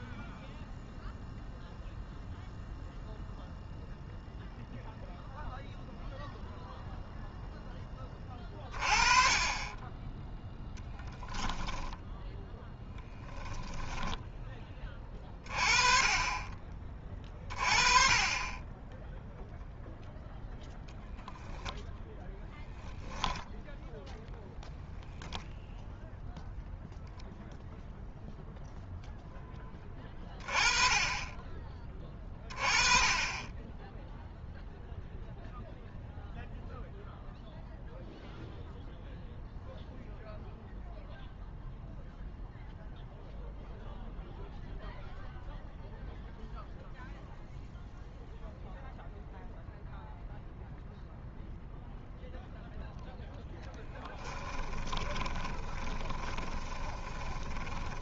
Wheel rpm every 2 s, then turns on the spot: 0, 0, 0, 0, 30, 0, 10, 20, 30, 20, 0, 0, 0, 0, 0, 30, 30, 0, 0, 0, 0, 0, 0, 0, 0, 0, 0, 20, 20.
54-58